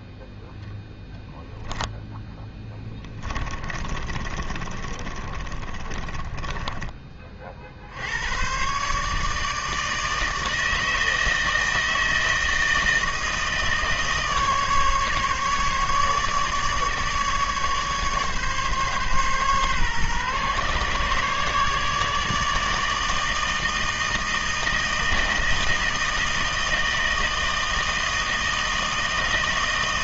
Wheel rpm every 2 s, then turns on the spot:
0, 10, 30, 20, 130, 160, 160, 150, 150, 140, 140, 160, 160, 160, 160.
2-6